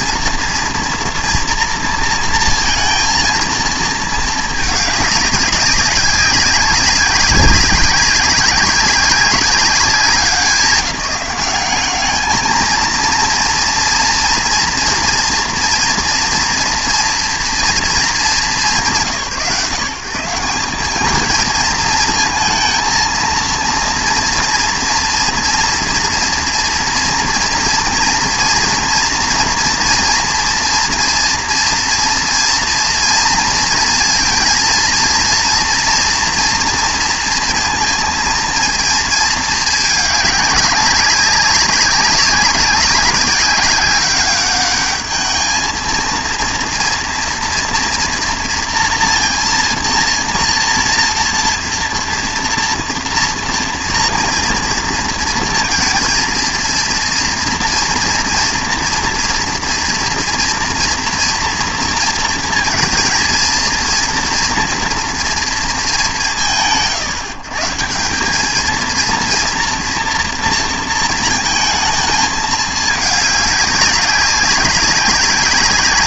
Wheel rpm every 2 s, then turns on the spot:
230, 230, 210, 190, 190, 180, 220, 230, 230, 150, 190, 230, 230, 230, 230, 230, 230, 230, 230, 230, 200, 200, 200, 230, 230, 230, 230, 230, 230, 240, 240, 230, 230, 130, 220, 230, 210, 200.
none